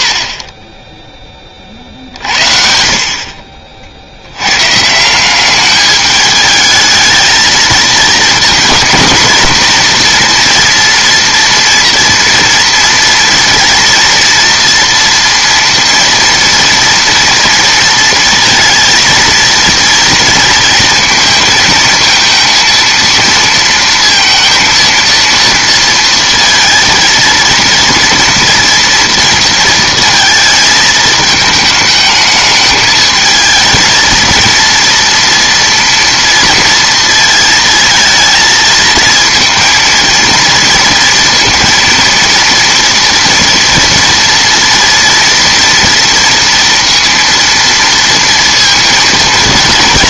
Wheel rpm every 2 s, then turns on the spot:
30, 60, 100, 210, 220, 240, 230, 240, 230, 230, 230, 230, 230, 230, 230, 220, 220, 230, 230, 220, 230, 230, 230, 230, 230.
none